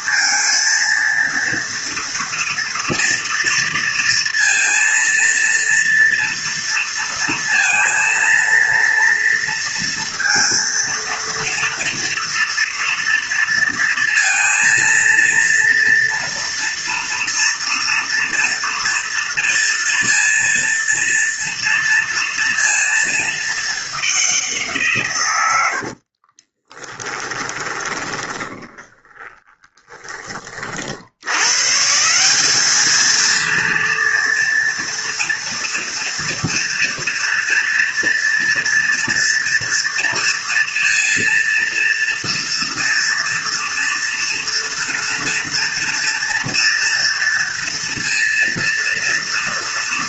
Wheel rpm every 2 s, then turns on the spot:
230, 230, 230, 230, 230, 230, 230, 230, 230, 230, 230, 220, 130, 10, 30, 80, 220, 230, 230, 230, 230, 230, 230, 230, 230.
26-30